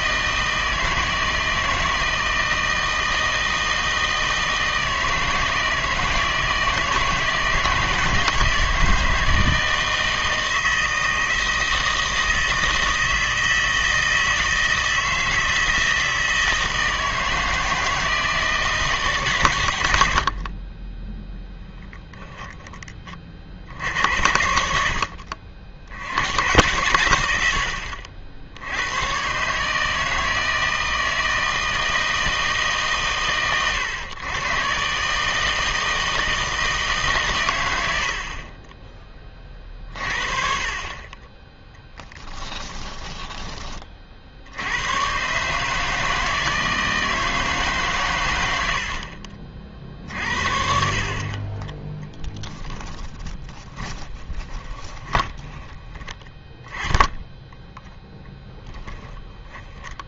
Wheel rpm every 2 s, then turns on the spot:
160, 160, 160, 160, 160, 160, 160, 160, 160, 160, 30, 10, 70, 100, 80, 160, 150, 120, 160, 30, 40, 10, 80, 160, 90, 50, 10, 20, 10, 10.
20-22 42-44 52-56 58-60